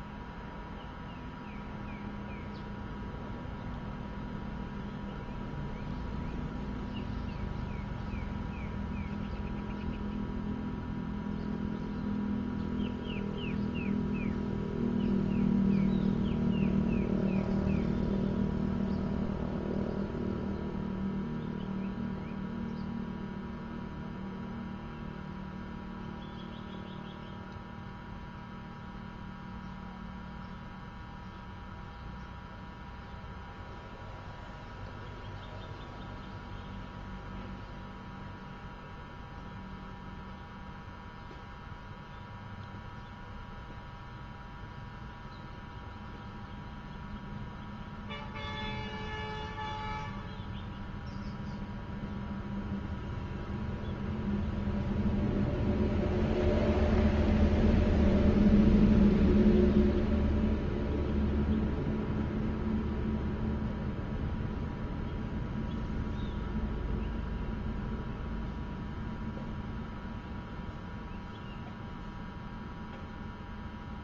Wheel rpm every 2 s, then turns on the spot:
0, 0, 0, 0, 0, 0, 0, 0, 0, 0, 0, 0, 0, 0, 0, 0, 0, 0, 0, 0, 0, 0, 0, 0, 0, 0, 0, 0, 0, 0, 0, 0, 0, 0, 0, 0, 0.
none